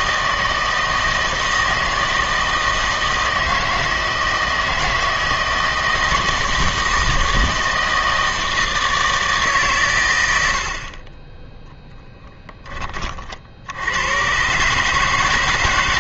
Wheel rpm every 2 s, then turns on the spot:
160, 160, 160, 160, 160, 70, 20, 140.
none